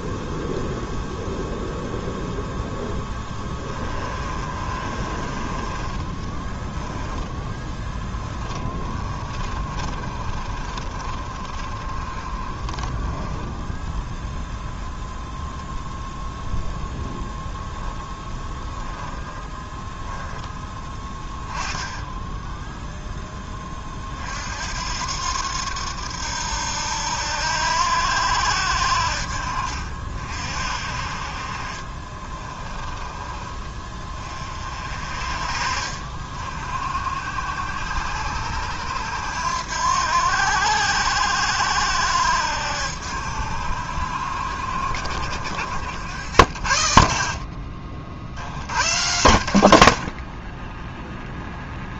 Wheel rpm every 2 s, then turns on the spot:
0, 0, 30, 10, 20, 30, 20, 10, 0, 10, 10, 0, 70, 80, 70, 50, 20, 40, 50, 80, 80, 70, 60, 70, 90, 30.
4-14 18-20 32-34